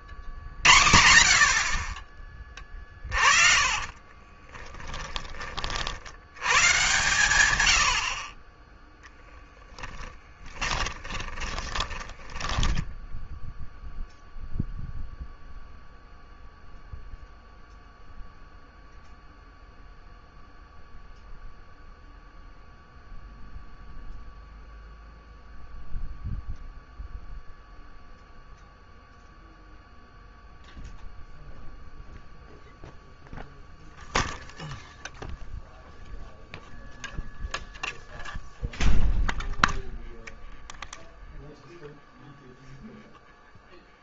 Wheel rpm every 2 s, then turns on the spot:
90, 20, 30, 130, 20, 30, 20, 0, 0, 0, 0, 0, 0, 0, 0, 0, 0, 0, 0, 0, 0, 0.
2-4 8-14